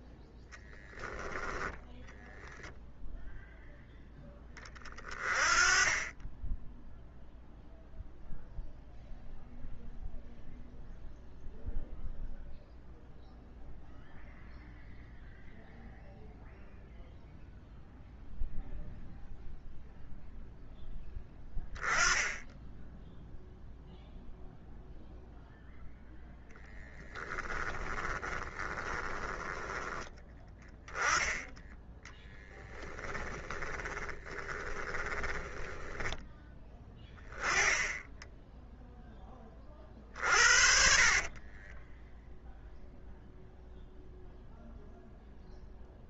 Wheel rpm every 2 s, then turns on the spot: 0, 0, 10, 10, 0, 0, 0, 0, 0, 0, 0, 10, 0, 10, 20, 10, 10, 30, 10, 10, 50, 0, 0.
28-36 40-42